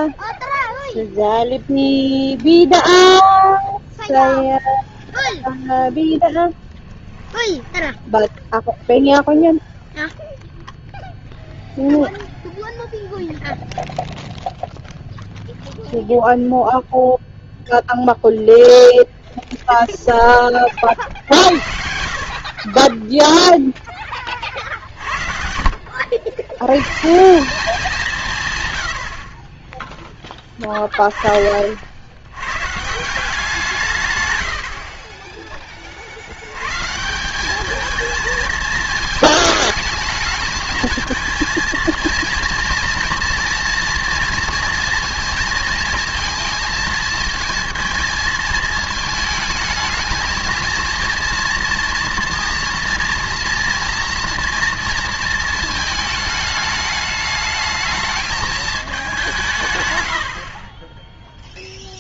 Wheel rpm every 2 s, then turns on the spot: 0, 0, 0, 10, 0, 0, 0, 0, 0, 0, 30, 30, 40, 120, 100, 30, 130, 80, 120, 220, 220, 240, 230, 220, 220, 230, 230, 230, 210, 210, 30.
24-26